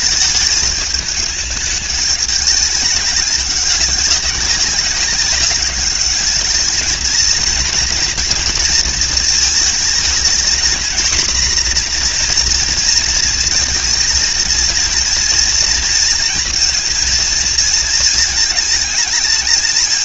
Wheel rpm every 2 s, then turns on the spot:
210, 200, 190, 230, 230, 240, 230, 230, 230, 220.
none